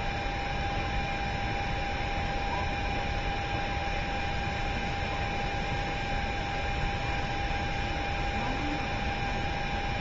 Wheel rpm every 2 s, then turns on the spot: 0, 0, 0, 0, 0.
none